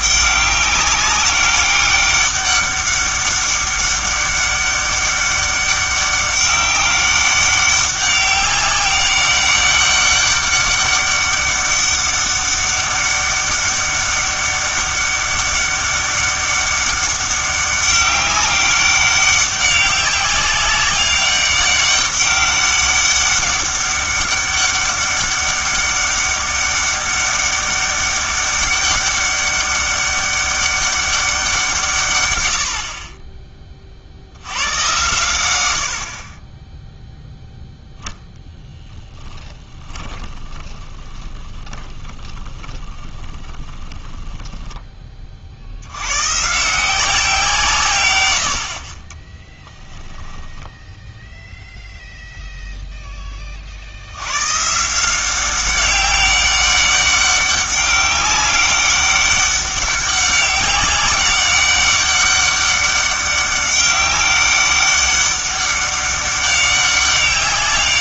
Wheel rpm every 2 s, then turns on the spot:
200, 200, 200, 200, 200, 200, 200, 200, 200, 200, 200, 200, 200, 200, 200, 200, 70, 110, 10, 10, 20, 20, 10, 150, 60, 10, 0, 140, 200, 190, 190, 200, 200, 200.
38-44 50-52